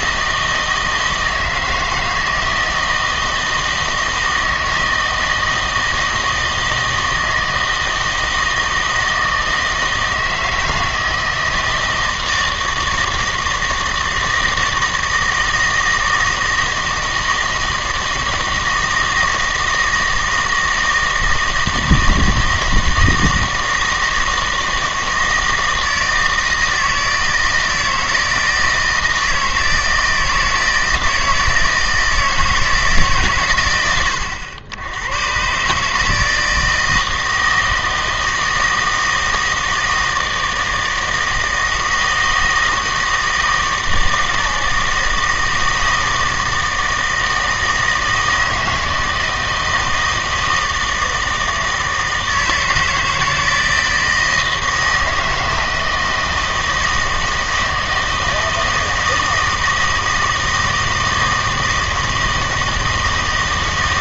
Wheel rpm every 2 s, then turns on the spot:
160, 160, 160, 160, 160, 160, 160, 160, 160, 160, 160, 160, 160, 160, 160, 160, 160, 90, 160, 160, 160, 160, 160, 160, 160, 160, 160, 160, 160, 160, 160, 160.
none